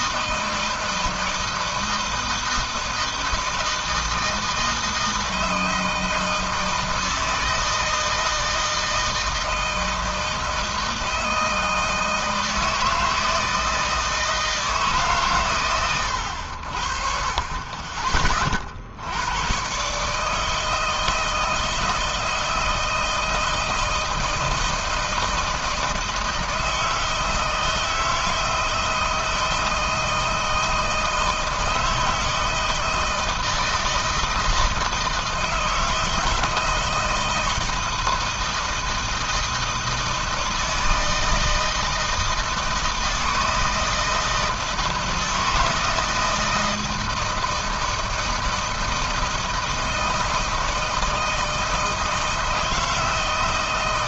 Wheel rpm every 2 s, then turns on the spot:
160, 160, 160, 160, 160, 160, 160, 160, 80, 40, 160, 160, 160, 160, 160, 160, 160, 160, 160, 160, 160, 160, 160, 160, 160, 160, 160.
none